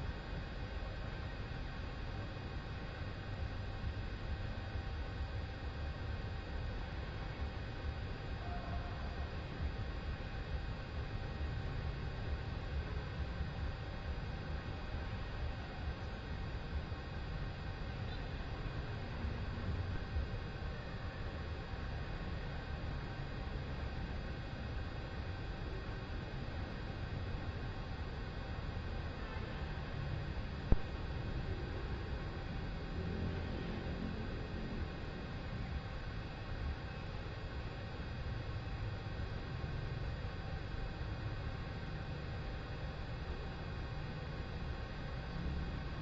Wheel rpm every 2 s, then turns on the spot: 0, 0, 0, 0, 0, 0, 0, 0, 0, 0, 0, 0, 0, 0, 0, 0, 0, 0, 0, 0, 0, 0, 0.
none